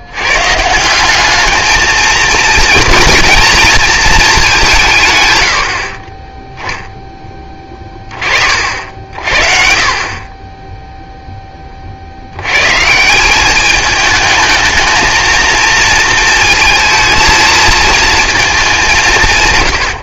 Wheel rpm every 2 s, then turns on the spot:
160, 230, 180, 0, 50, 10, 140, 220, 230, 180.
none